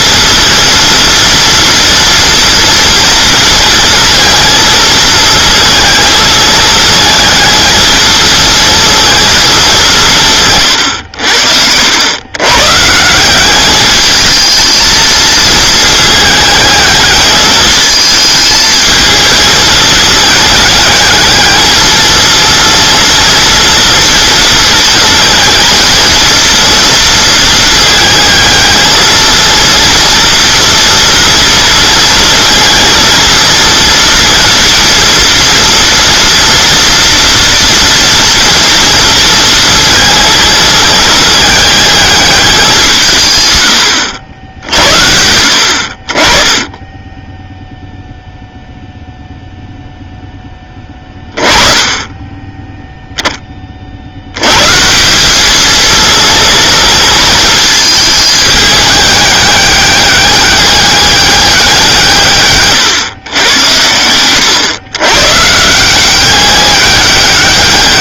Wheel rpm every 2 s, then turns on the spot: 230, 230, 220, 220, 230, 130, 140, 220, 210, 220, 220, 230, 230, 230, 220, 230, 230, 230, 230, 230, 220, 190, 70, 20, 0, 10, 0, 140, 230, 210, 200, 130, 110, 190.
none